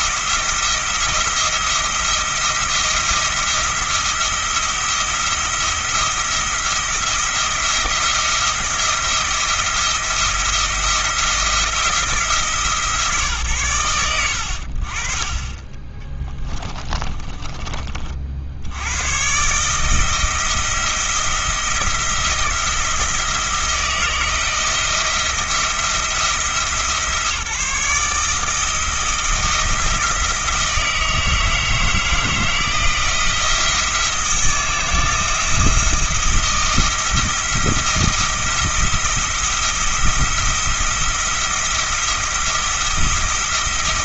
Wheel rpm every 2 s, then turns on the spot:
170, 170, 170, 170, 170, 160, 160, 70, 20, 80, 170, 160, 160, 160, 160, 160, 160, 170, 170, 160, 170, 170.
16-18